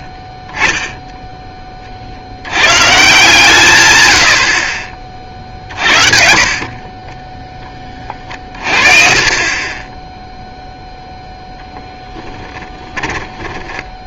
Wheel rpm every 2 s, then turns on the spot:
10, 130, 50, 40, 40, 0, 10.
12-14